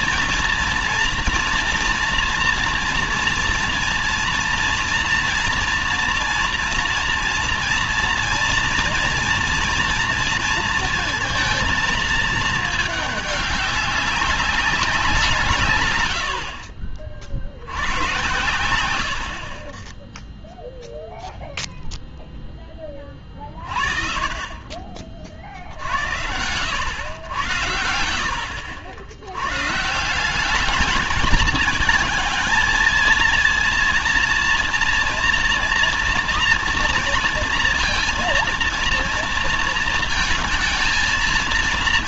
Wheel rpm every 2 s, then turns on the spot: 230, 230, 230, 230, 230, 230, 210, 190, 50, 100, 0, 20, 40, 90, 70, 210, 230, 230, 240, 230, 220.
none